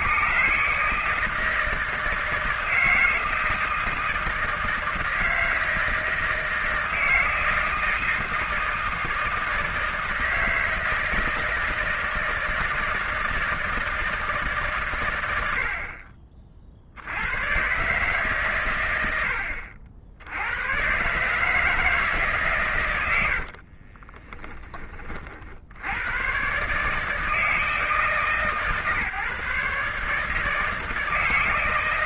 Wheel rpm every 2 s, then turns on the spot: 130, 160, 160, 160, 160, 160, 160, 150, 50, 130, 90, 140, 20, 120, 150, 160.
24-26